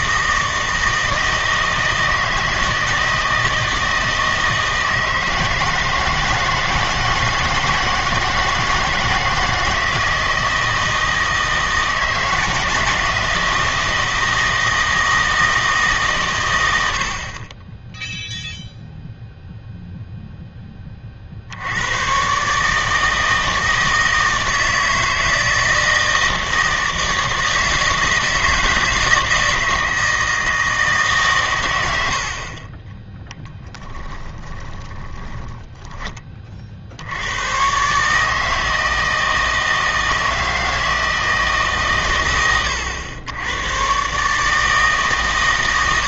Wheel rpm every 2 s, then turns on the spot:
160, 160, 160, 160, 160, 160, 160, 160, 90, 0, 20, 150, 160, 160, 160, 160, 30, 20, 50, 160, 160, 100, 150.
34-36